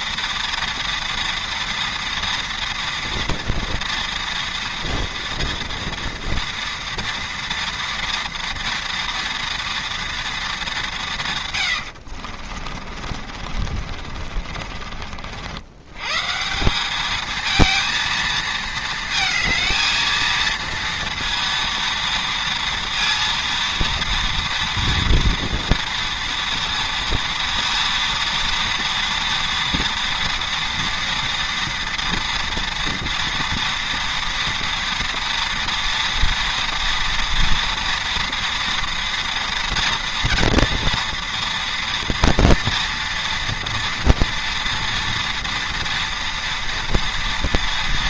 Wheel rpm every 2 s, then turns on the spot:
230, 230, 230, 230, 230, 170, 40, 70, 220, 220, 230, 230, 230, 230, 230, 230, 230, 230, 230, 230, 230, 230, 230, 230.
12-14